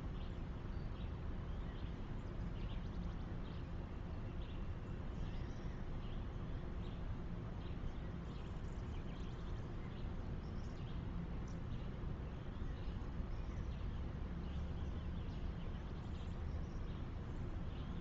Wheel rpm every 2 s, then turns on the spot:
0, 0, 0, 0, 0, 0, 0, 0, 0.
none